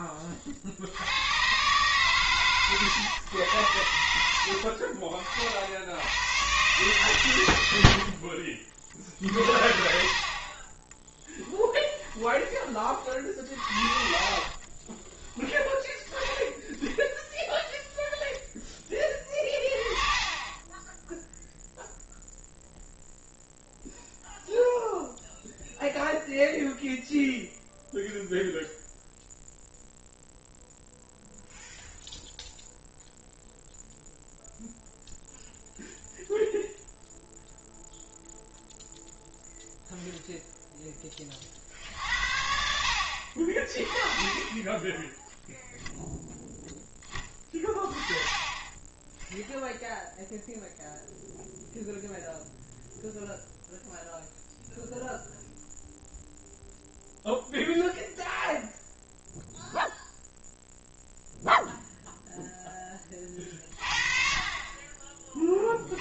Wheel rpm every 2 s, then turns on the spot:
70, 130, 40, 130, 60, 30, 30, 30, 10, 20, 10, 0, 0, 0, 0, 0, 0, 0, 0, 0, 0, 70, 10, 10, 20, 0, 0, 0, 0, 0, 0, 10, 30.
4-6 10-12 14-16